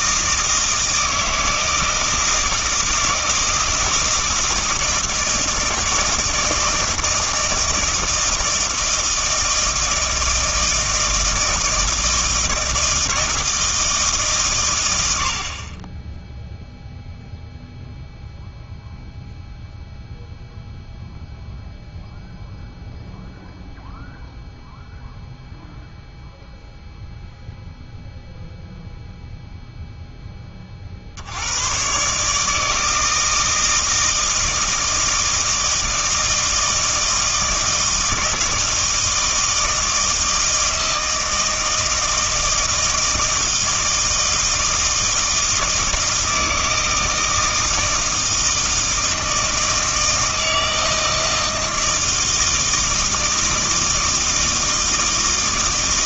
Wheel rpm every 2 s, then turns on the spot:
160, 160, 160, 160, 160, 160, 160, 120, 0, 0, 0, 0, 0, 0, 0, 30, 160, 160, 160, 160, 160, 160, 160, 160, 160, 160, 160, 160.
none